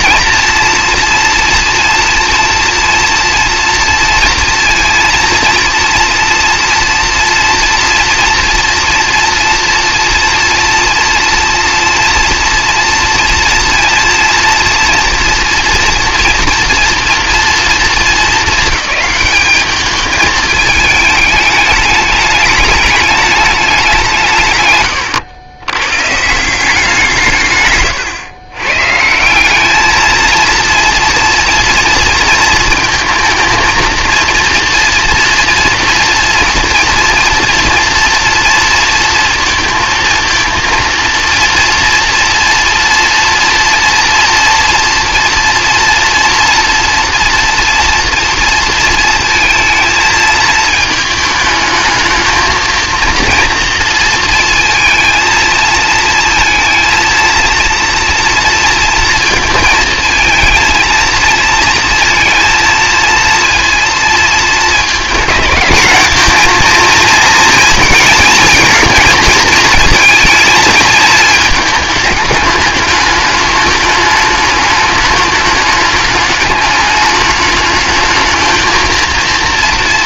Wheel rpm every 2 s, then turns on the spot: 230, 230, 230, 230, 240, 230, 230, 230, 230, 220, 210, 210, 120, 170, 130, 230, 230, 230, 230, 230, 230, 230, 230, 240, 230, 220, 230, 230, 230, 230, 230, 230, 220, 230, 230, 220, 210, 210, 210, 230.
none